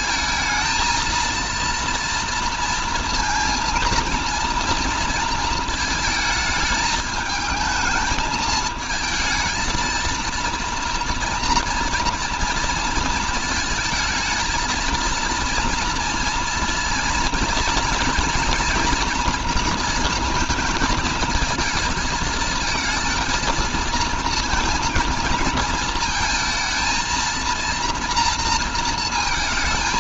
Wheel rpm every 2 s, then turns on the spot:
220, 230, 230, 220, 220, 230, 230, 230, 230, 230, 230, 230, 230, 230, 220.
none